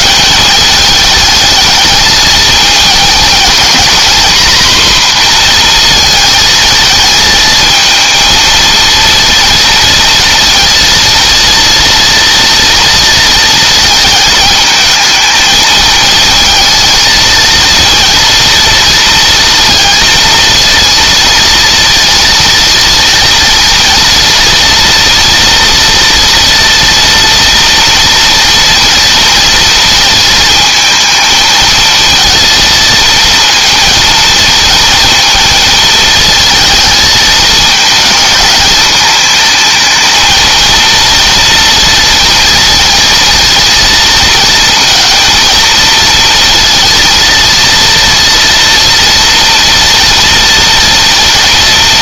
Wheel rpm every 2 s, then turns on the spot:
180, 220, 240, 220, 230, 230, 230, 220, 220, 230, 230, 230, 230, 230, 230, 220, 220, 230, 220, 220, 230, 230, 230, 230, 230, 230.
none